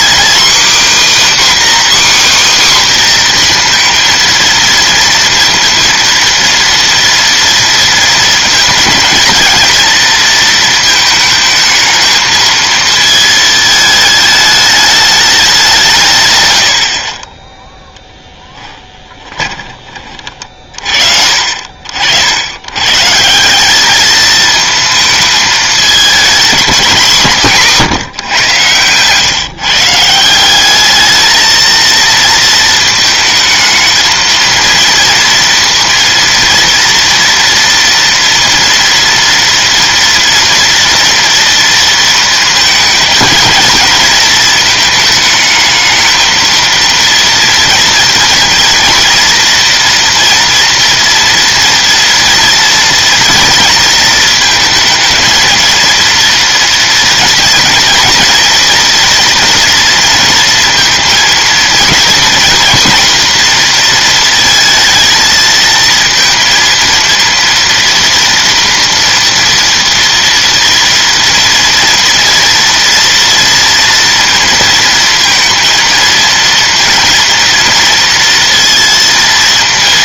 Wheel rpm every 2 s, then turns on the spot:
280, 260, 230, 230, 230, 220, 220, 210, 70, 20, 50, 120, 220, 170, 110, 200, 220, 230, 230, 230, 240, 220, 220, 230, 230, 240, 230, 220, 230, 240, 230, 240, 220, 230, 230, 230, 230, 230, 230, 230.
18-20